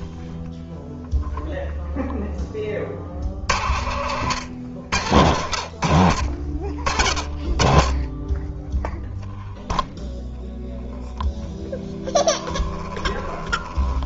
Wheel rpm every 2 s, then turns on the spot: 0, 10, 90, 50, 10, 0, 20.
12-14